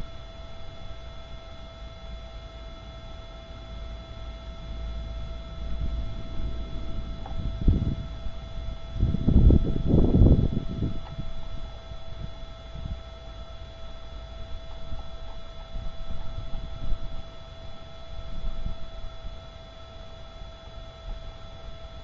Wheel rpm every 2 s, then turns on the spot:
0, 0, 0, 0, 0, 0, 0, 0, 0, 0, 0.
none